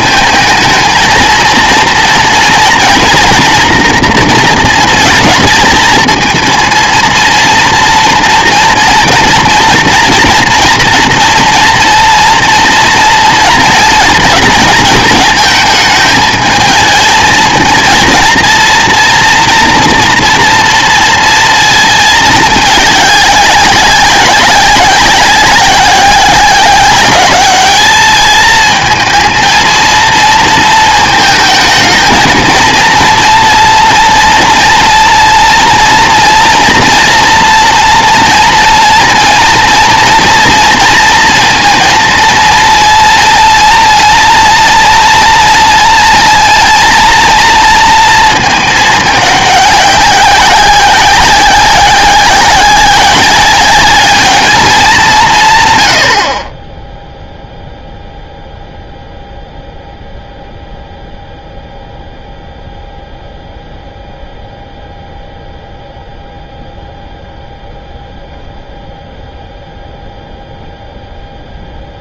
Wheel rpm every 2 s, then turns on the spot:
220, 240, 230, 220, 230, 230, 230, 230, 220, 230, 230, 210, 190, 190, 220, 230, 230, 230, 230, 230, 230, 230, 230, 230, 220, 190, 190, 210, 20, 0, 0, 0, 0, 0, 0, 0.
none